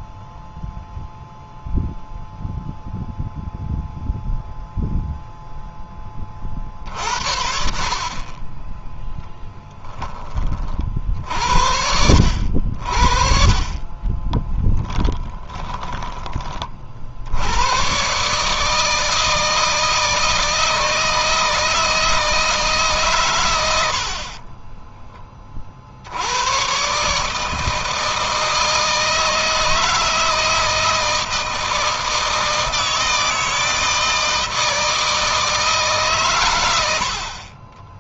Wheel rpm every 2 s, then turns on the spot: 0, 0, 0, 50, 10, 40, 60, 10, 50, 160, 160, 150, 20, 130, 160, 160, 160, 160, 90.
14-16 24-26